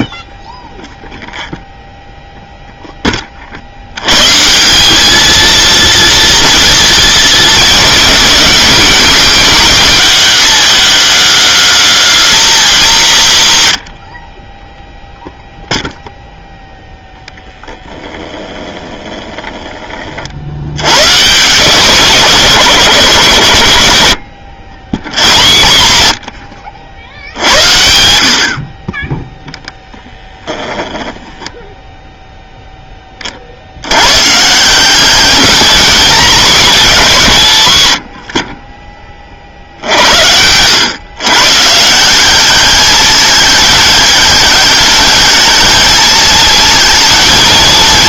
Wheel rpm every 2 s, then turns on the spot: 0, 0, 190, 230, 170, 210, 230, 10, 0, 20, 80, 130, 80, 80, 40, 10, 0, 160, 200, 20, 90, 200, 210, 220.
18-20 30-32